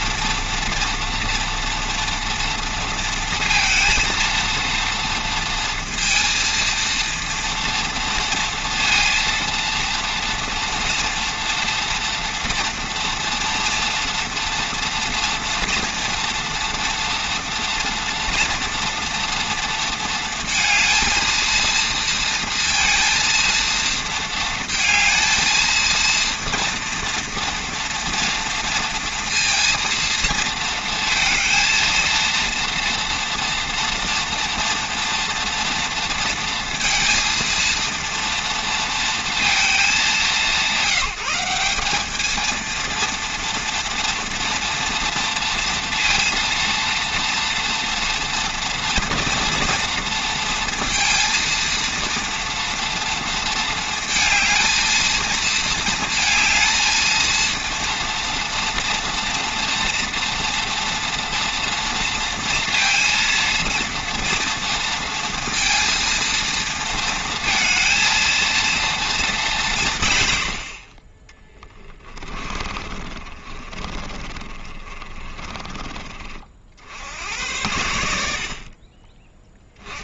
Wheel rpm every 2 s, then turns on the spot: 240, 230, 230, 230, 230, 240, 230, 240, 240, 230, 230, 230, 220, 240, 230, 230, 230, 240, 230, 230, 170, 230, 230, 230, 240, 230, 230, 220, 220, 230, 240, 230, 230, 230, 230, 70, 30, 40, 60, 50.
72-76